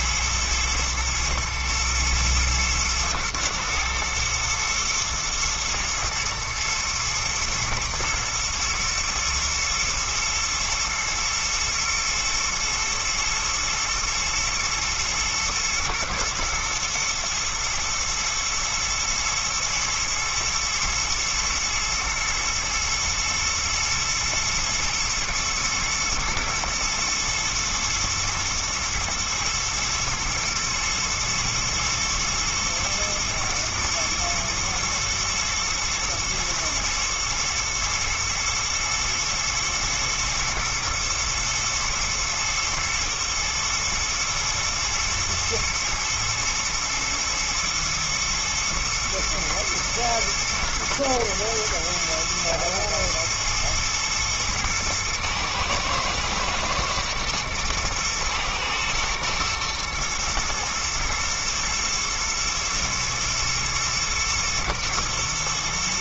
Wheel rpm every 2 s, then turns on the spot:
110, 110, 120, 120, 110, 110, 120, 120, 110, 110, 120, 120, 120, 110, 120, 110, 120, 110, 110, 110, 120, 120, 110, 120, 120, 120, 110, 120, 110, 110, 110, 110, 120.
none